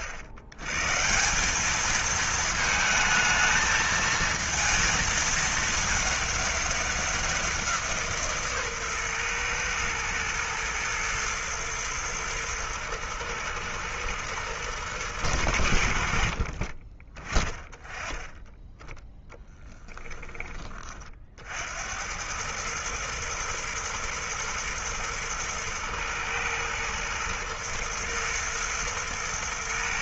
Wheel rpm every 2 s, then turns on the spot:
110, 220, 230, 200, 140, 120, 110, 110, 40, 10, 20, 100, 110, 110, 110.
none